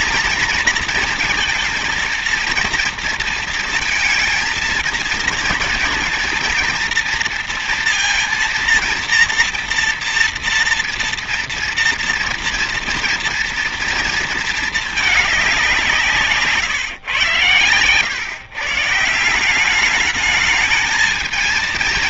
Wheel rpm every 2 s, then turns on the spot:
230, 230, 230, 230, 230, 230, 230, 230, 140, 140, 210.
none